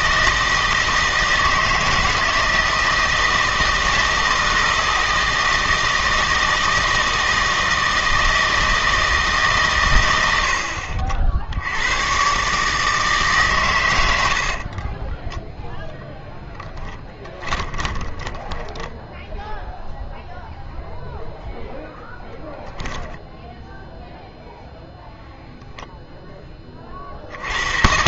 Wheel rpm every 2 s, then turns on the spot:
160, 160, 160, 160, 160, 60, 150, 40, 20, 10, 0, 10, 0, 30.
14-20